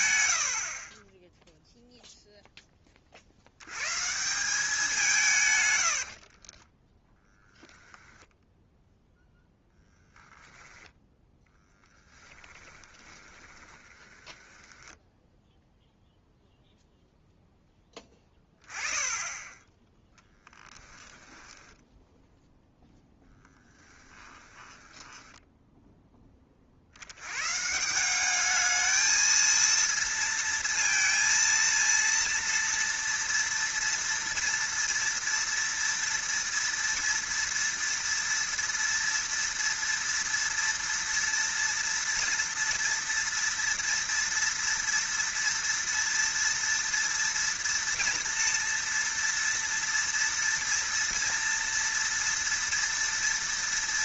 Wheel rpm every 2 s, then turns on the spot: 40, 10, 190, 20, 0, 0, 20, 10, 0, 20, 10, 0, 10, 50, 210, 230, 230, 230, 230, 230, 230, 240, 230, 230, 240, 230, 230.
6-8 12-16 20-22 24-26